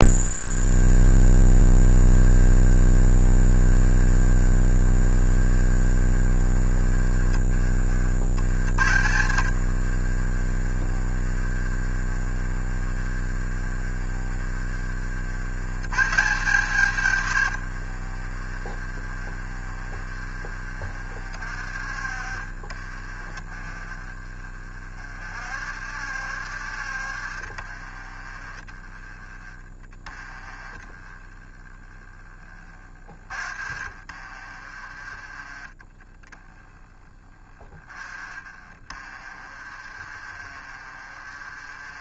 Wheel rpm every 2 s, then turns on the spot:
30, 30, 30, 30, 80, 30, 30, 50, 130, 30, 40, 30, 40, 50, 30, 20, 30, 30, 30, 40, 30.
0-6 8-14 18-20 34-36 38-42